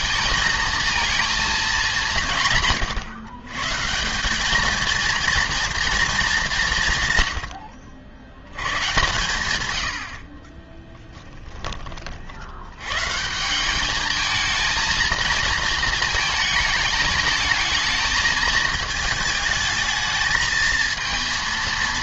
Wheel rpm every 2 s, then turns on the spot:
230, 150, 220, 180, 120, 20, 100, 220, 220, 220, 220.
10-12